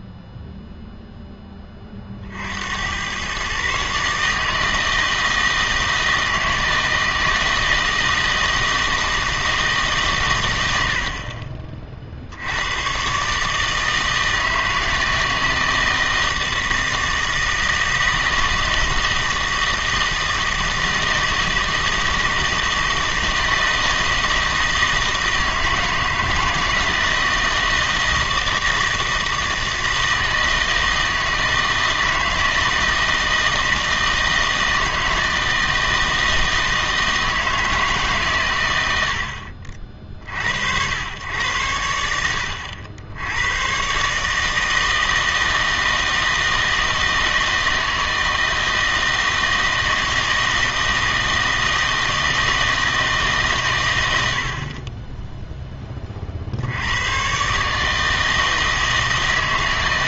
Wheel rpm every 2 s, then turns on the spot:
0, 70, 160, 160, 160, 90, 90, 160, 160, 160, 160, 160, 160, 160, 160, 160, 160, 160, 160, 110, 70, 80, 160, 160, 160, 160, 160, 50, 70, 160.
none